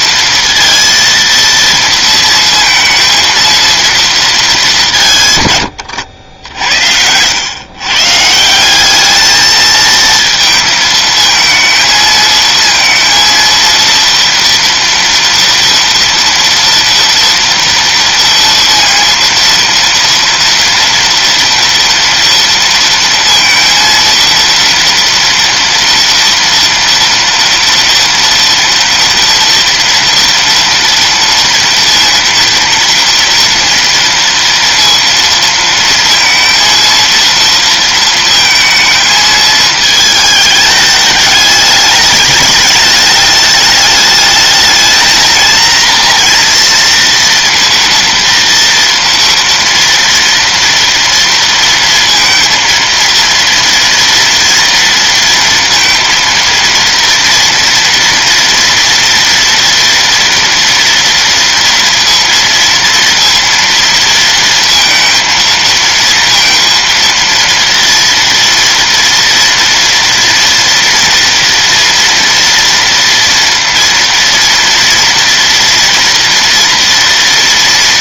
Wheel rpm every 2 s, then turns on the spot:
230, 230, 200, 70, 180, 220, 230, 230, 230, 230, 240, 230, 230, 230, 230, 240, 230, 230, 230, 230, 210, 210, 220, 230, 230, 230, 230, 230, 230, 230, 230, 230, 230, 230, 230, 240, 230, 230, 230.
none